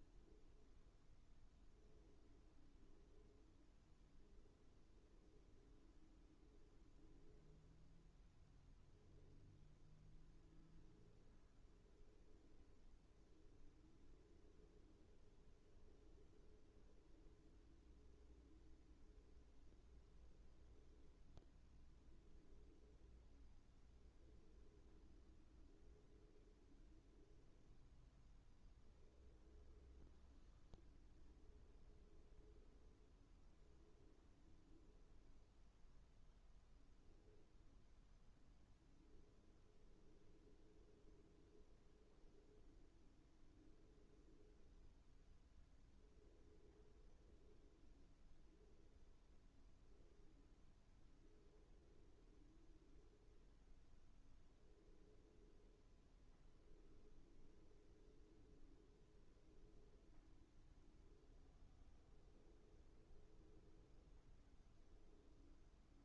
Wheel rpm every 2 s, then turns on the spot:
0, 0, 0, 0, 0, 0, 0, 0, 0, 0, 0, 0, 0, 0, 0, 0, 0, 0, 0, 0, 0, 0, 0, 0, 0, 0, 0, 0, 0, 0, 0, 0, 0.
none